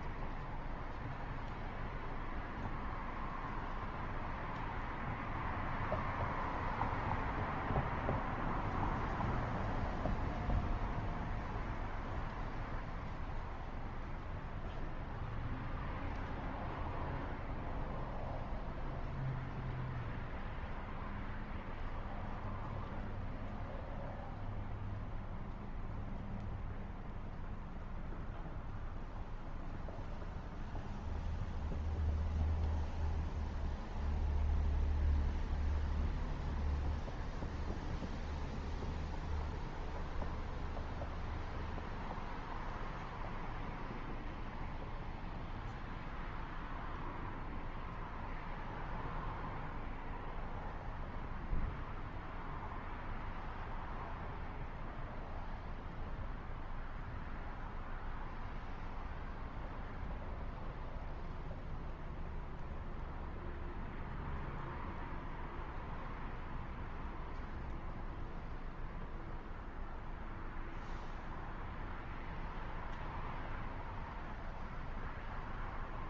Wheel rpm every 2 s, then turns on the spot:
0, 0, 0, 0, 0, 0, 0, 0, 0, 0, 0, 0, 0, 0, 0, 0, 0, 0, 0, 0, 0, 0, 0, 0, 0, 0, 0, 0, 0, 0, 0, 0, 0, 0, 0, 0, 0, 0.
none